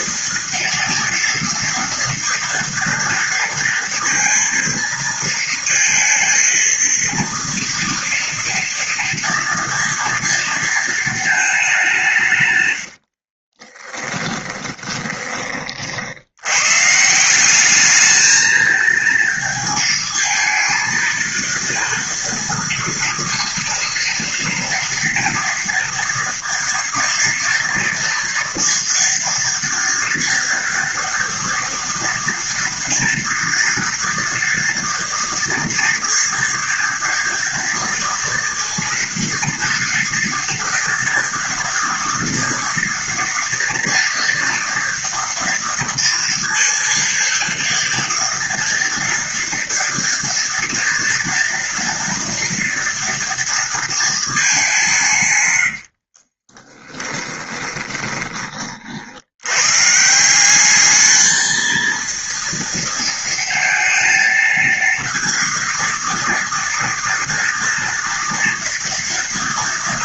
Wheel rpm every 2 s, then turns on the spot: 230, 230, 230, 230, 230, 230, 130, 20, 110, 220, 220, 230, 230, 230, 230, 230, 230, 240, 230, 230, 230, 230, 230, 230, 230, 230, 230, 200, 30, 30, 190, 230, 230, 230, 240.
12-16 56-58